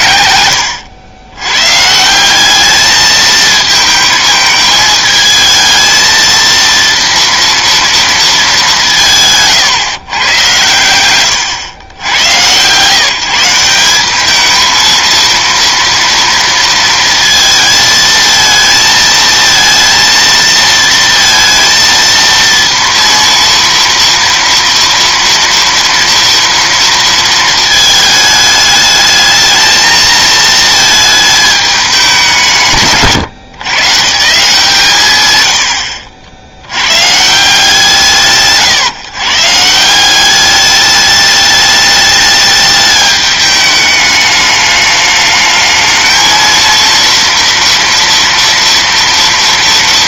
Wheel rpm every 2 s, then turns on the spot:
110, 200, 220, 230, 200, 110, 130, 220, 230, 230, 230, 230, 240, 230, 210, 220, 160, 150, 90, 140, 200, 210, 210, 230, 230.
none